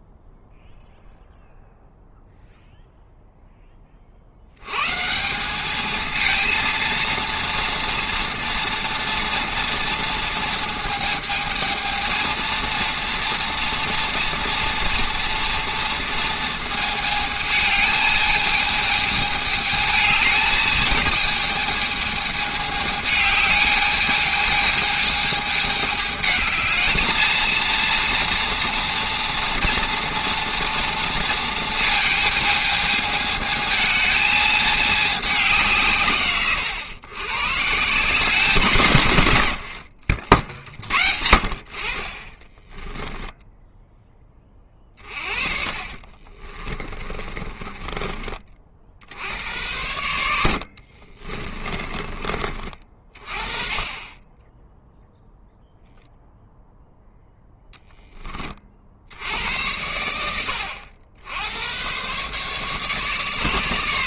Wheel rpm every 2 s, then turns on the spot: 0, 0, 120, 230, 230, 220, 230, 240, 220, 220, 220, 210, 220, 220, 230, 240, 220, 220, 120, 160, 50, 10, 30, 30, 50, 70, 40, 10, 0, 50, 90, 140.
42-48 50-52